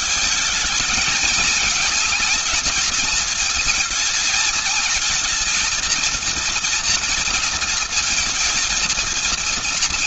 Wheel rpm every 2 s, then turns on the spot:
220, 230, 220, 230, 230.
none